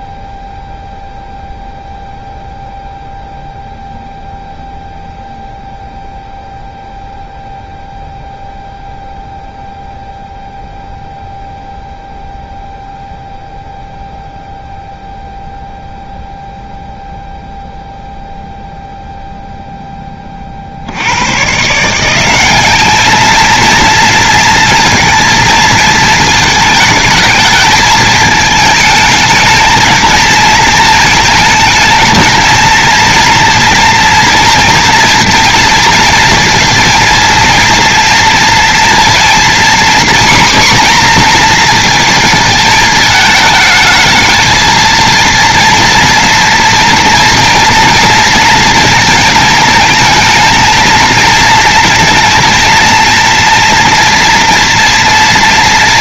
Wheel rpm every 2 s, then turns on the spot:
0, 0, 0, 0, 0, 0, 0, 0, 0, 0, 40, 200, 230, 220, 210, 230, 230, 230, 230, 230, 250, 220, 230, 230, 230, 220, 230, 230.
none